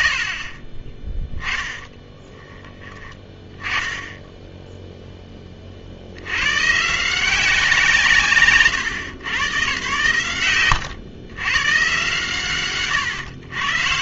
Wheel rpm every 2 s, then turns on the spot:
60, 20, 10, 120, 130, 100, 140.
0-2 8-12